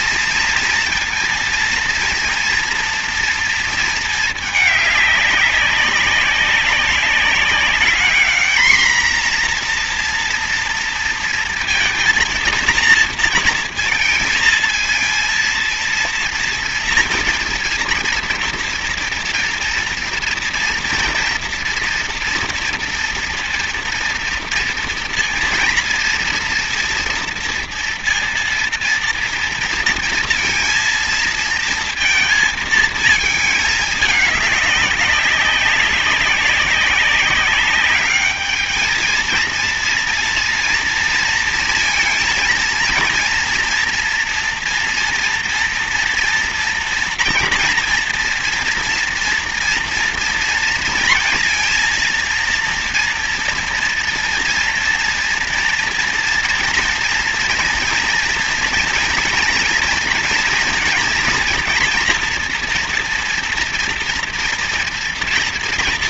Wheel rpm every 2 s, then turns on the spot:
230, 230, 220, 200, 220, 230, 230, 230, 230, 230, 240, 230, 230, 230, 230, 230, 230, 200, 200, 210, 230, 230, 230, 240, 230, 230, 230, 240, 230, 230, 240, 230, 240.
none